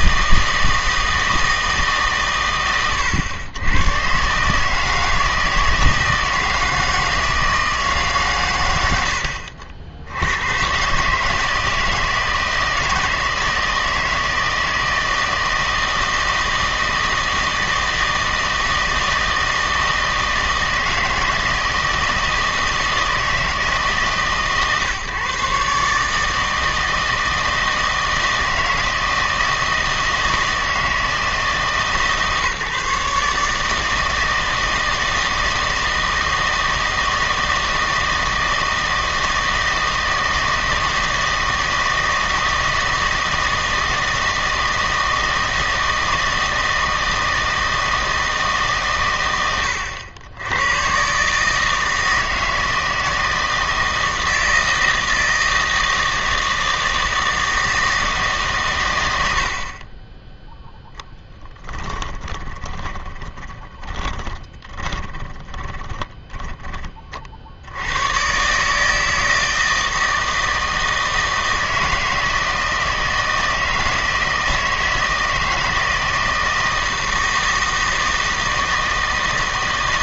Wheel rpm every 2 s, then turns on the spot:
160, 110, 150, 160, 100, 120, 160, 160, 160, 160, 160, 160, 130, 160, 160, 160, 140, 160, 160, 160, 160, 160, 160, 160, 140, 110, 160, 160, 160, 120, 0, 10, 20, 20, 150, 160, 160, 160, 160, 160.
62-66